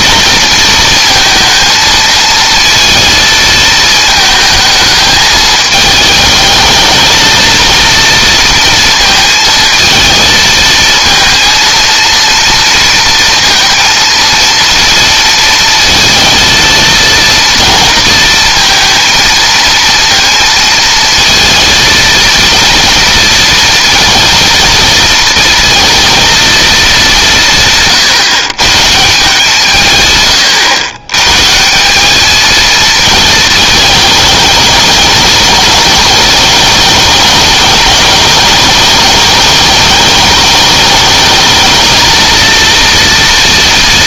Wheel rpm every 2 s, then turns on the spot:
230, 230, 220, 220, 230, 230, 230, 230, 230, 230, 220, 230, 230, 210, 140, 100, 230, 210, 210, 210, 210, 230.
none